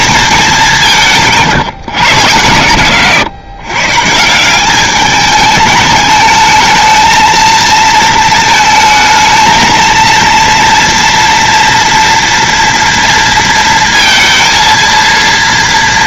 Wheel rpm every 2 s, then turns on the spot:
200, 120, 190, 220, 220, 230, 230, 230.
none